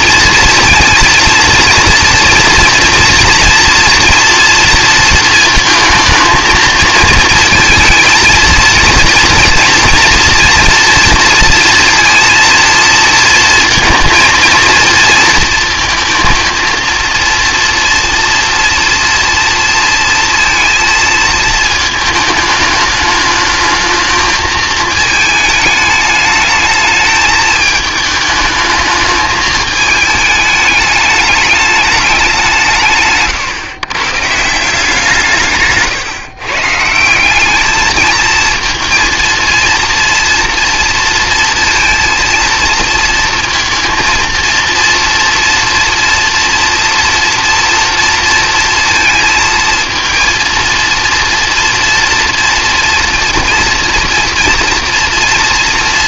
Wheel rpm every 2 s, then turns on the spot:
230, 230, 230, 230, 230, 230, 230, 230, 230, 240, 230, 220, 220, 210, 220, 210, 170, 170, 140, 230, 230, 230, 230, 230, 230, 230, 230, 230.
none